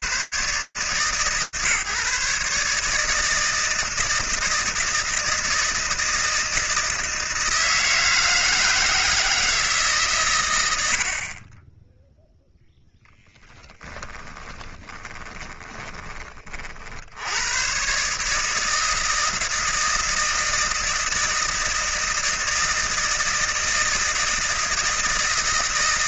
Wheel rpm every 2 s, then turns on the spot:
150, 160, 160, 160, 160, 30, 10, 20, 120, 160, 160, 160, 160.
12-16